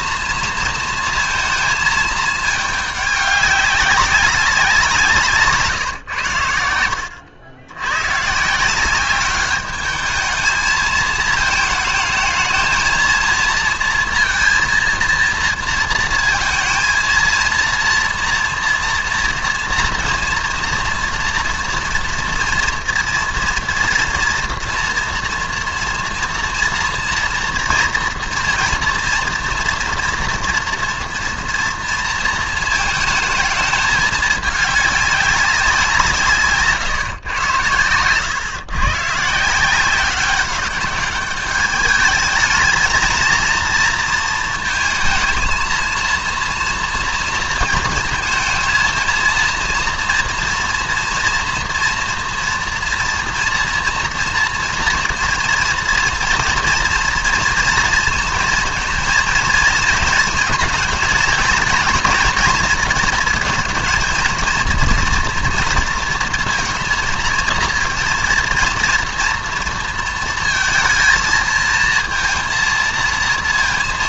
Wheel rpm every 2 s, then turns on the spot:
230, 210, 190, 80, 160, 220, 220, 230, 230, 230, 230, 230, 230, 240, 230, 240, 220, 200, 140, 120, 200, 220, 220, 230, 230, 240, 230, 230, 240, 230, 220, 230, 230, 230, 230, 230, 230.
none